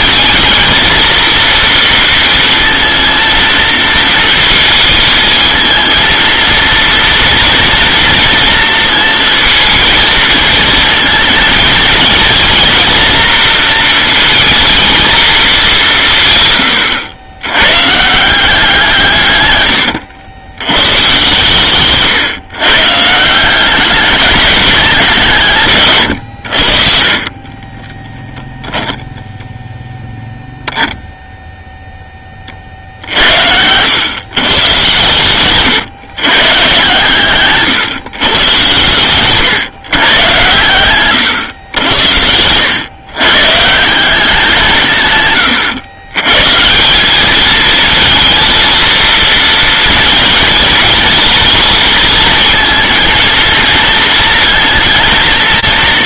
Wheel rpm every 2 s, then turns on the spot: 220, 230, 220, 230, 230, 230, 230, 230, 120, 160, 110, 140, 190, 60, 10, 0, 40, 130, 130, 120, 110, 120, 160, 150, 230, 220, 230, 230.
40-42